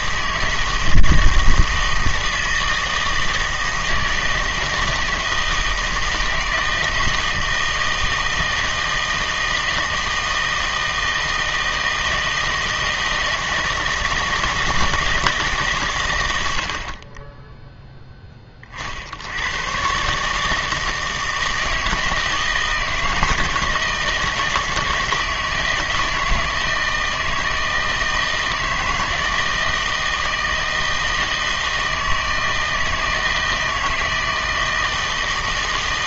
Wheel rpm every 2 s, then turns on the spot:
160, 160, 160, 160, 160, 160, 160, 160, 80, 30, 150, 160, 160, 160, 160, 160, 160, 160.
none